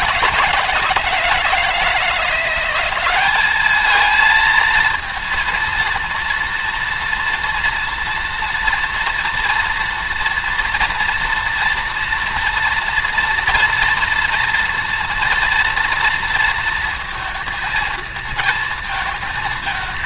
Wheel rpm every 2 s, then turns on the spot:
170, 180, 230, 230, 230, 230, 230, 230, 230, 220.
none